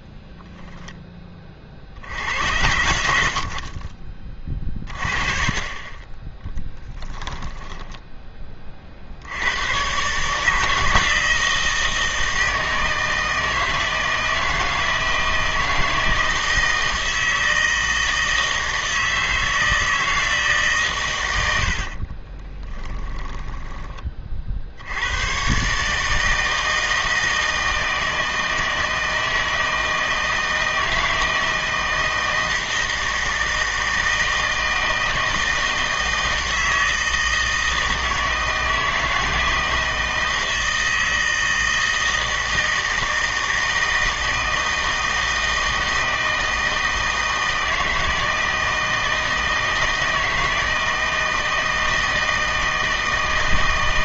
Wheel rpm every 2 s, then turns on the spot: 0, 90, 30, 10, 40, 160, 160, 160, 160, 160, 150, 10, 70, 160, 160, 160, 160, 160, 160, 160, 160, 160, 160, 160, 160, 160, 160.
6-8 22-24